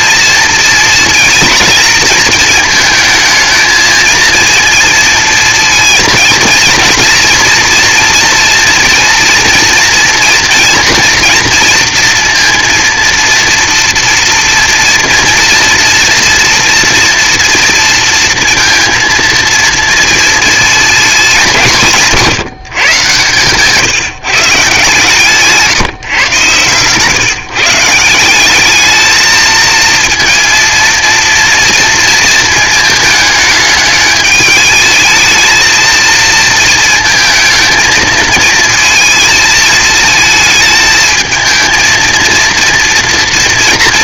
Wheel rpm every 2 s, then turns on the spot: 230, 220, 230, 230, 230, 240, 230, 230, 240, 230, 220, 140, 140, 130, 200, 230, 220, 220, 220, 220, 220, 230.
none